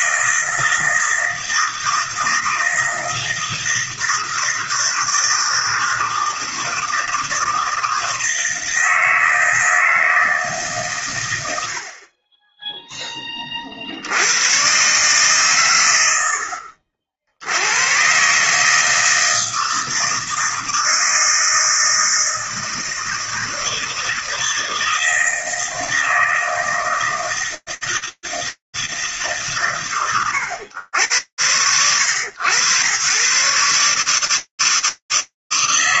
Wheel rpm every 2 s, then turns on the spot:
160, 160, 160, 160, 160, 140, 10, 120, 60, 150, 160, 160, 160, 160, 140, 90, 140, 160.
none